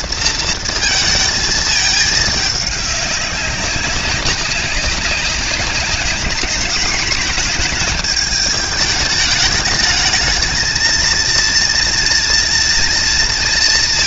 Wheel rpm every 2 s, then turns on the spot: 220, 200, 190, 220, 210, 230, 230.
none